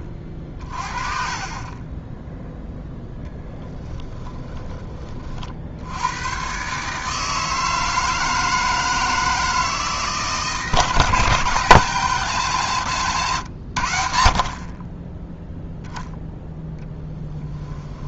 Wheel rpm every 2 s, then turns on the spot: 40, 0, 30, 140, 160, 160, 130, 30, 0.
none